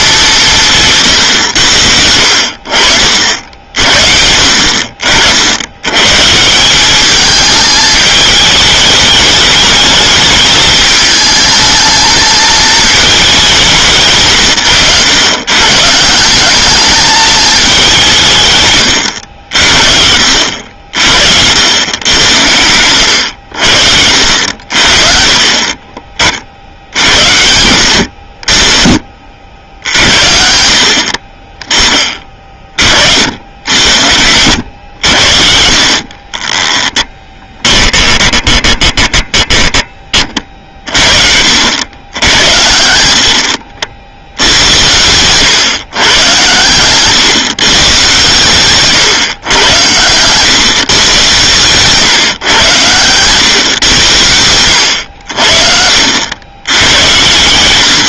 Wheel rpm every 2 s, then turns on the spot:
170, 60, 60, 170, 210, 210, 220, 140, 200, 130, 60, 90, 60, 60, 40, 60, 40, 90, 20, 20, 40, 100, 80, 110, 130, 120, 120, 90, 100.
36-40